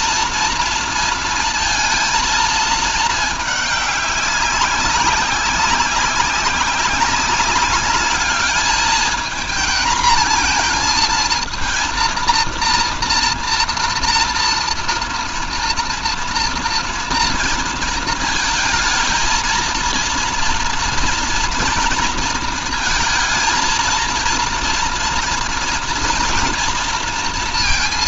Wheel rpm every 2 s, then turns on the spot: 230, 220, 200, 190, 220, 230, 230, 230, 230, 220, 230, 230, 230, 230.
none